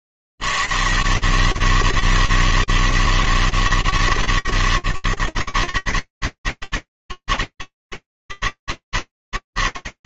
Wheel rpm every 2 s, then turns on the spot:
70, 160, 130, 150, 160.
none